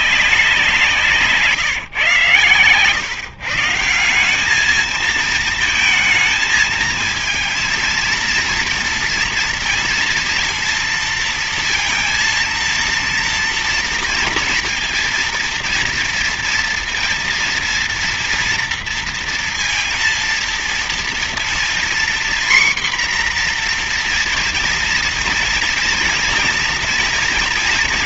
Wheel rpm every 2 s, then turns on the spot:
180, 130, 210, 220, 230, 230, 230, 230, 230, 230, 230, 250, 240, 230.
none